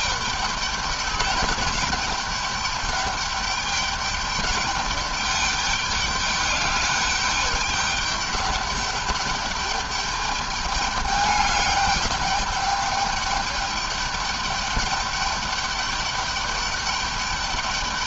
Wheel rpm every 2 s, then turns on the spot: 200, 200, 200, 210, 210, 210, 210, 200, 210.
none